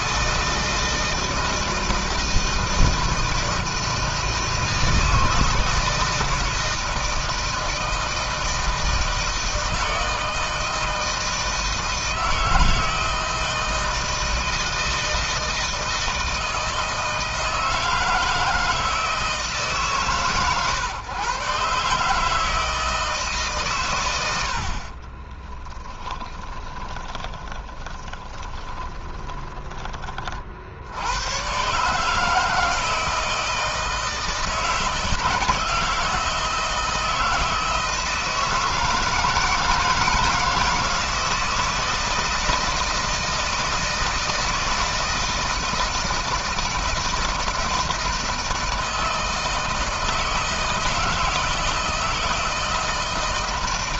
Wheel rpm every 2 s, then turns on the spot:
160, 160, 160, 160, 160, 160, 160, 160, 160, 160, 130, 160, 50, 10, 20, 60, 160, 150, 160, 160, 160, 160, 160, 160, 160, 160, 160.
24-30